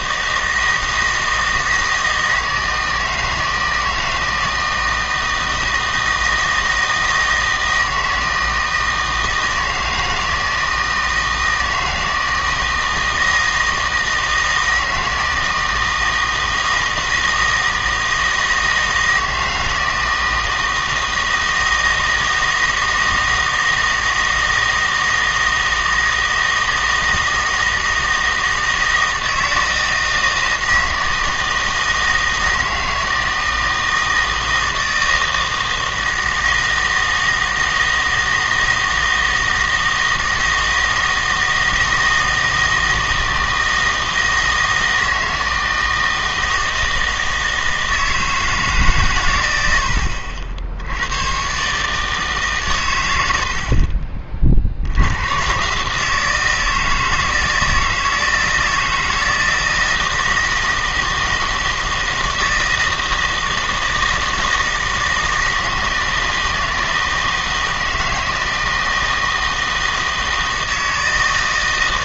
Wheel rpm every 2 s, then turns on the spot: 160, 160, 160, 160, 160, 160, 160, 160, 160, 160, 160, 160, 160, 160, 160, 160, 160, 160, 160, 160, 160, 160, 160, 160, 140, 70, 120, 70, 160, 160, 160, 160, 160, 160, 160, 160.
none